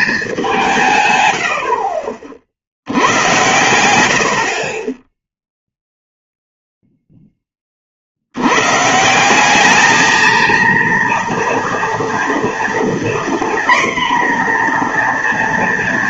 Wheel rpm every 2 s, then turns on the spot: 160, 70, 30, 0, 140, 230, 240, 240.
none